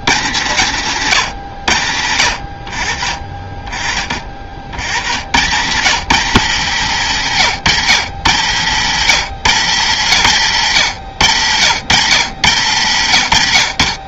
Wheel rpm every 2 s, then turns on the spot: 100, 40, 170, 150, 100, 120, 150.
none